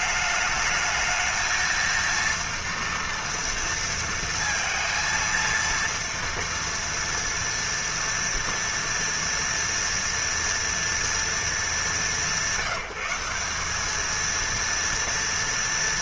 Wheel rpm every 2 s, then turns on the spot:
220, 230, 230, 230, 240, 240, 180, 230.
none